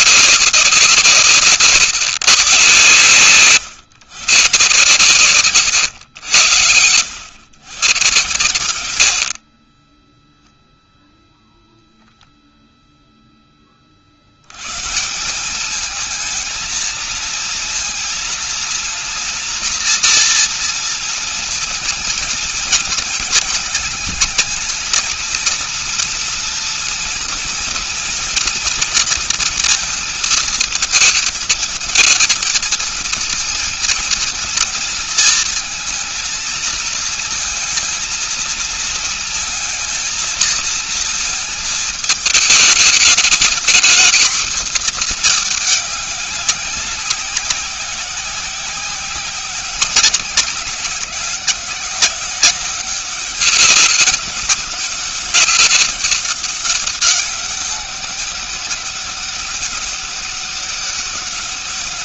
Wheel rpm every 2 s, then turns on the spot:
160, 120, 140, 90, 80, 0, 0, 140, 220, 230, 230, 230, 230, 240, 230, 220, 230, 230, 230, 230, 230, 220, 230, 190, 190, 200, 190, 200, 200, 200, 200.
none